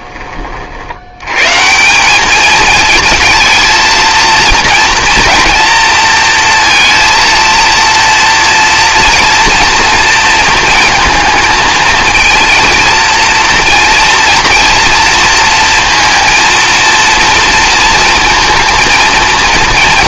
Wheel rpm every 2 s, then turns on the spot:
190, 230, 230, 230, 230, 230, 230, 230, 230, 230.
none